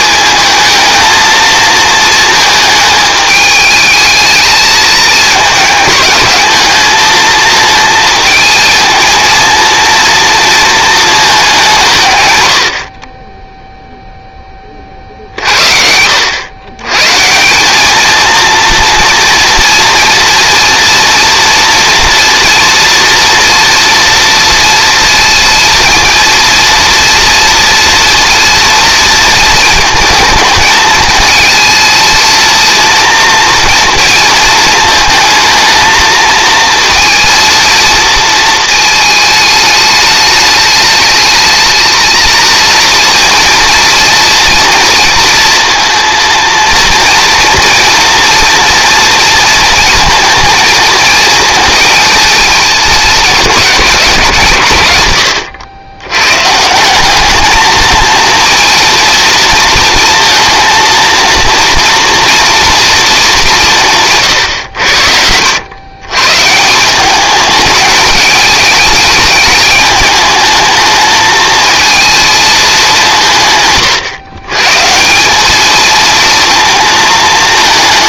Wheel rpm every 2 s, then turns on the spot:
220, 210, 220, 220, 230, 220, 40, 40, 120, 230, 230, 240, 230, 230, 230, 220, 230, 220, 230, 220, 210, 230, 230, 230, 230, 220, 220, 120, 170, 230, 230, 230, 100, 160, 210, 220, 200, 150, 230.
none